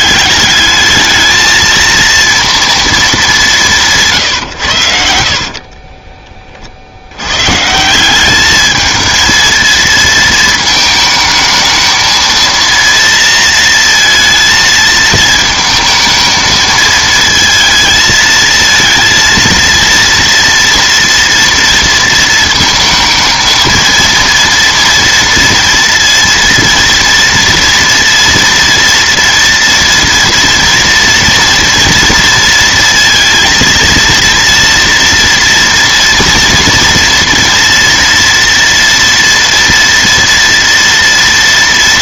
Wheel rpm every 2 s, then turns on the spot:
210, 230, 120, 50, 210, 220, 230, 230, 220, 230, 230, 220, 230, 230, 230, 230, 230, 230, 230, 230, 230.
none